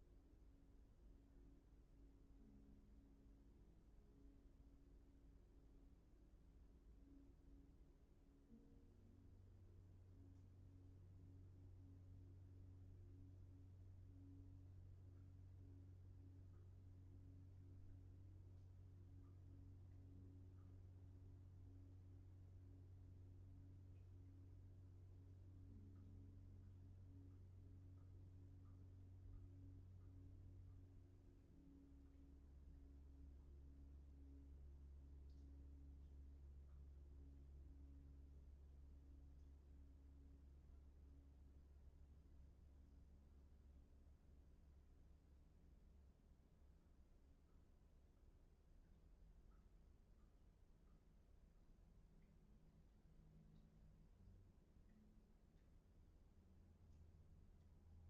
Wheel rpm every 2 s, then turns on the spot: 0, 0, 0, 0, 0, 0, 0, 0, 0, 0, 0, 0, 0, 0, 0, 0, 0, 0, 0, 0, 0, 0, 0, 0, 0, 0, 0, 0, 0.
none